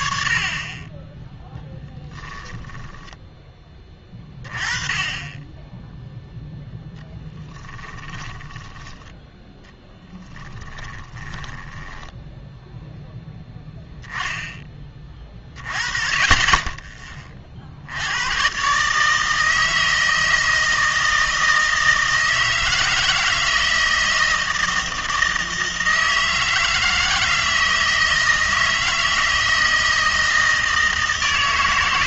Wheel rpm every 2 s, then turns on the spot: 30, 10, 20, 0, 10, 30, 0, 20, 20, 130, 160, 160, 160, 160, 160, 160.
2-4 8-12